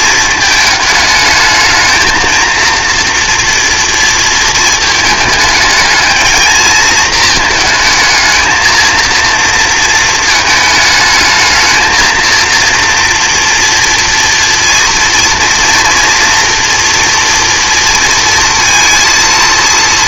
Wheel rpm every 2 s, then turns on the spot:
220, 230, 220, 220, 220, 220, 230, 230, 230, 230.
none